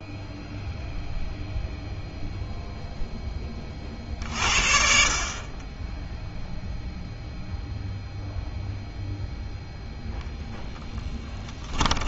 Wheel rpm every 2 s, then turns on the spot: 0, 0, 50, 0, 0, 10.
none